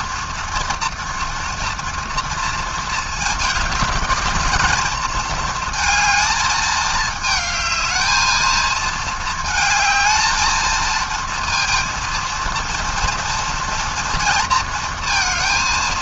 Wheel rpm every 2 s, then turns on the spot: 230, 230, 220, 220, 220, 220, 230, 230.
none